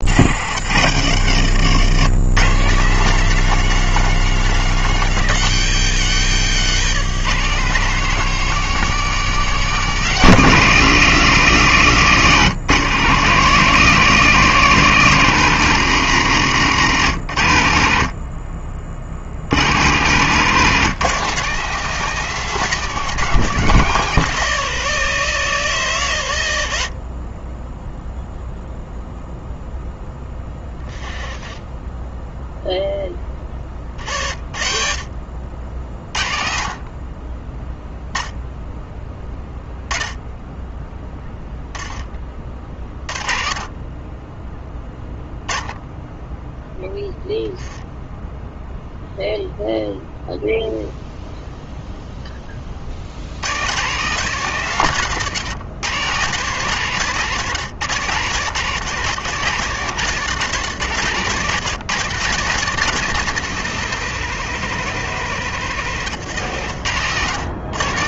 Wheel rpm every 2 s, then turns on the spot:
100, 190, 180, 160, 210, 170, 140, 170, 130, 60, 160, 180, 160, 40, 0, 10, 10, 50, 30, 10, 10, 30, 10, 0, 0, 0, 60, 140, 150, 130, 120, 170, 170, 130.
none